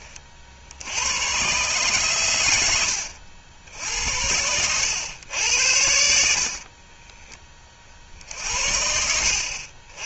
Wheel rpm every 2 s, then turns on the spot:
70, 90, 90, 50, 70.
none